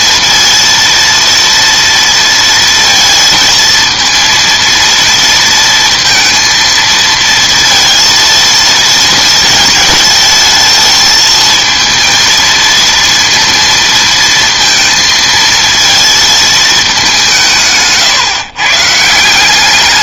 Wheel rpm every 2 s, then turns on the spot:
230, 230, 230, 230, 230, 220, 230, 230, 220, 140.
none